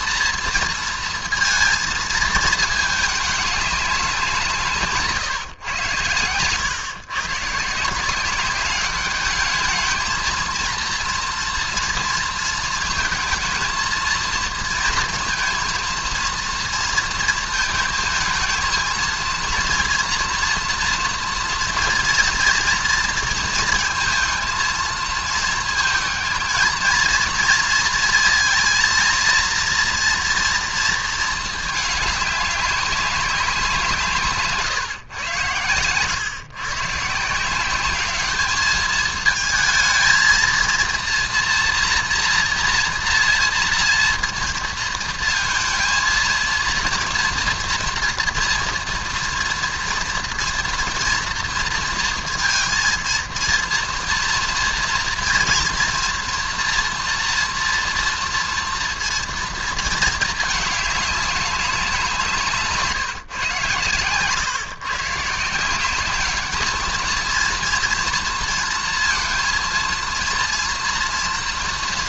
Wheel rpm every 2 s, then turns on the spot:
230, 220, 150, 130, 200, 230, 220, 230, 230, 220, 240, 230, 230, 230, 230, 230, 200, 140, 140, 210, 230, 240, 230, 230, 240, 230, 230, 230, 230, 230, 210, 150, 140, 220, 230, 230.
none